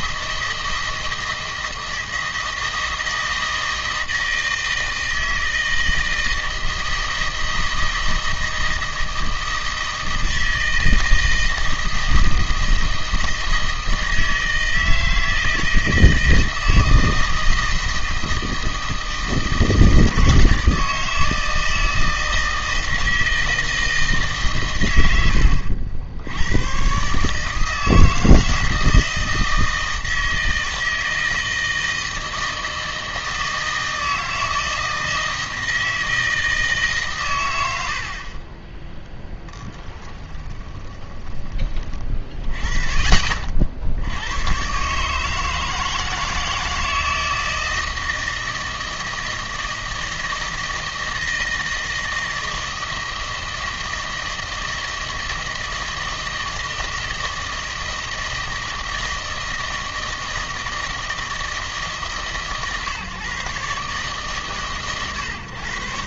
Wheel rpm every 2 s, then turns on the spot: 160, 160, 160, 160, 160, 160, 160, 160, 160, 160, 160, 160, 120, 110, 160, 160, 160, 160, 160, 20, 10, 40, 120, 160, 160, 160, 160, 160, 160, 160, 160, 140, 130.
40-42